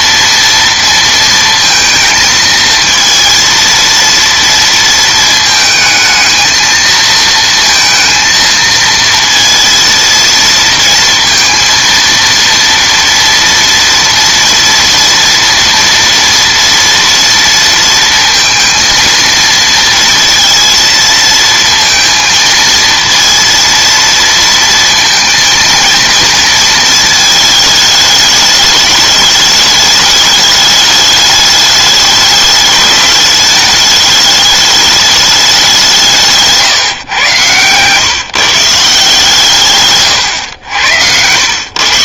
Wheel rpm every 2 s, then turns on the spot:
230, 230, 230, 220, 230, 230, 230, 240, 230, 230, 230, 230, 230, 230, 210, 210, 210, 210, 150, 160, 100.
40-42